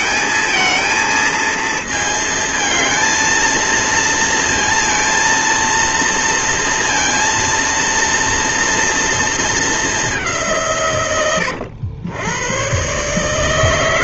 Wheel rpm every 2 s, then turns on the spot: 220, 220, 230, 230, 230, 160, 110.
none